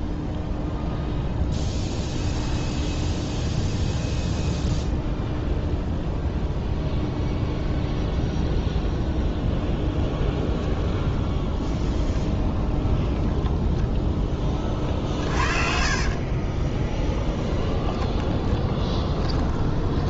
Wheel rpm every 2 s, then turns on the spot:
0, 0, 0, 0, 0, 10, 10, 40, 20, 10.
14-20